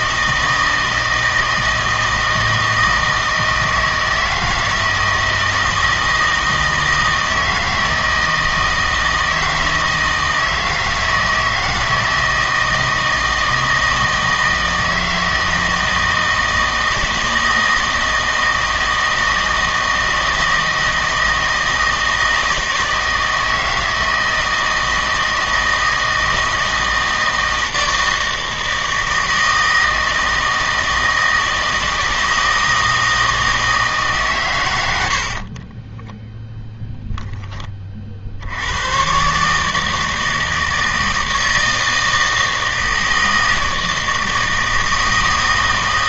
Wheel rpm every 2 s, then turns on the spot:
160, 160, 160, 160, 160, 160, 160, 160, 160, 160, 160, 160, 160, 160, 160, 160, 160, 110, 20, 90, 160, 160, 160.
none